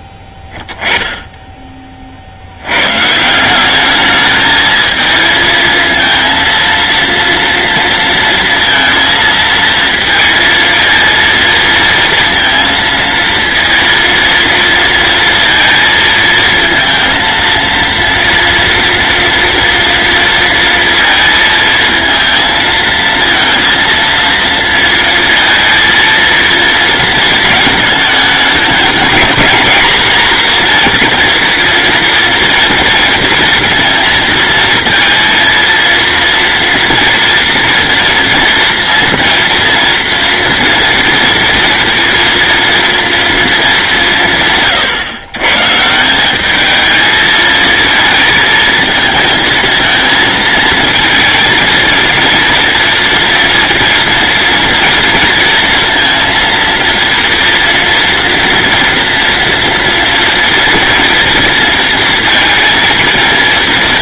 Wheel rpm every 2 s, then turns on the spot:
10, 110, 220, 230, 230, 230, 230, 230, 230, 230, 230, 220, 230, 230, 210, 240, 230, 230, 230, 230, 230, 230, 150, 220, 220, 220, 230, 230, 230, 240, 230, 230.
none